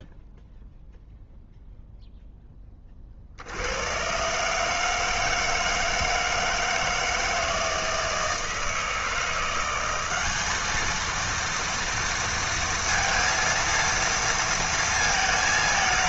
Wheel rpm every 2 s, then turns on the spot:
0, 20, 160, 160, 160, 220, 230, 230.
none